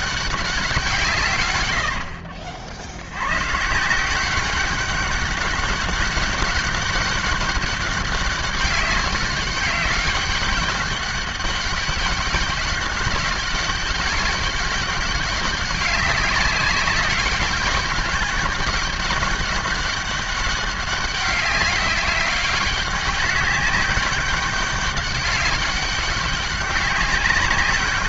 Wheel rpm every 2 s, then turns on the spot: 180, 70, 190, 190, 200, 200, 190, 190, 190, 200, 190, 190, 200, 190.
none